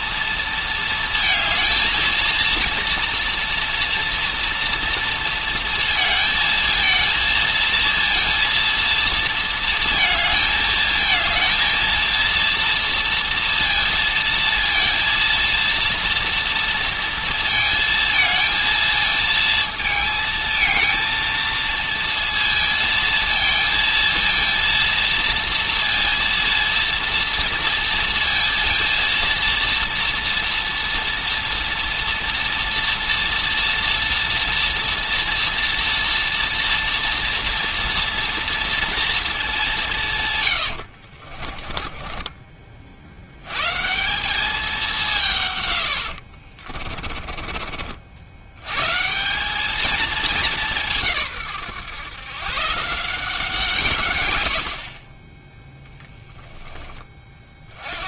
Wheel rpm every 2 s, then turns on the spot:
230, 230, 230, 220, 230, 220, 230, 230, 230, 220, 220, 230, 230, 230, 230, 230, 230, 230, 230, 240, 70, 80, 170, 30, 160, 160, 170, 20, 20.
40-42 46-48 54-56